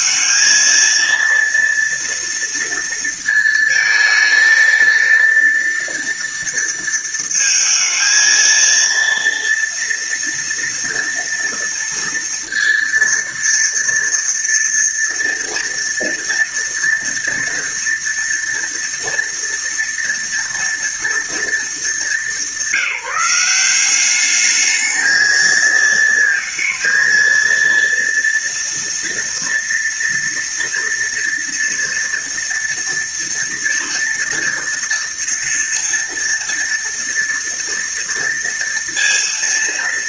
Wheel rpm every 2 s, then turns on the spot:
220, 230, 220, 230, 230, 230, 230, 230, 230, 230, 230, 200, 200, 230, 230, 230, 240, 230, 230, 230.
none